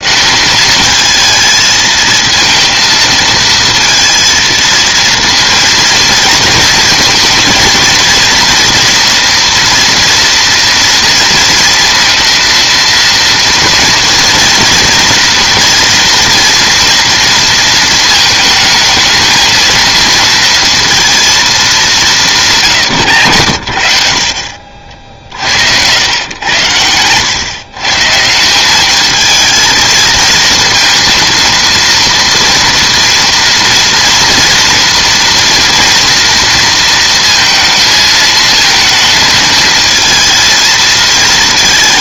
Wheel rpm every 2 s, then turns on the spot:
220, 230, 230, 230, 230, 230, 230, 230, 230, 220, 230, 140, 50, 110, 180, 230, 240, 230, 230, 220, 230.
22-24